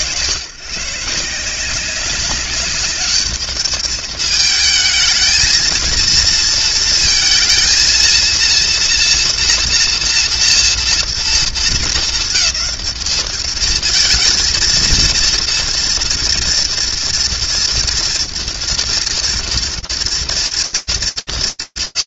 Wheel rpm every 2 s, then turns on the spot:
140, 210, 220, 230, 240, 220, 210, 230, 230, 230, 220.
none